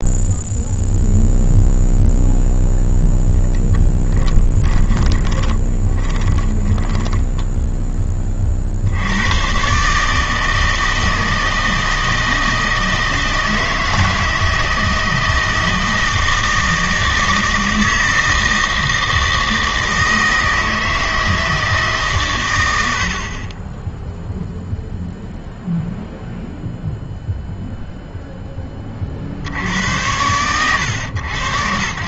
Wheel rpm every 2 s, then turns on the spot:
0, 0, 20, 20, 50, 160, 160, 160, 160, 160, 160, 100, 0, 0, 20, 100.
4-8